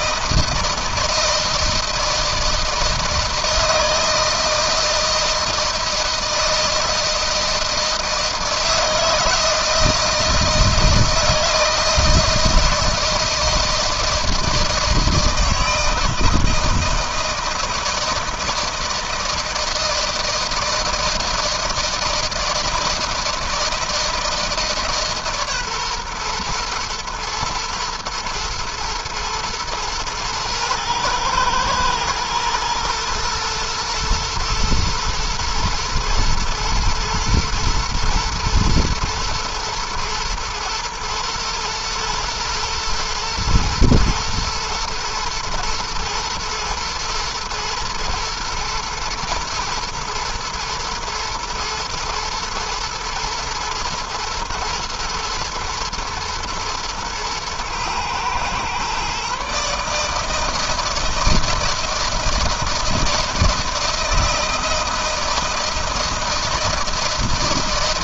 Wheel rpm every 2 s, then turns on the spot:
160, 160, 160, 160, 160, 160, 170, 160, 160, 160, 160, 160, 150, 120, 120, 120, 120, 110, 110, 120, 120, 110, 110, 120, 110, 120, 110, 110, 120, 130, 160, 160, 160, 160.
none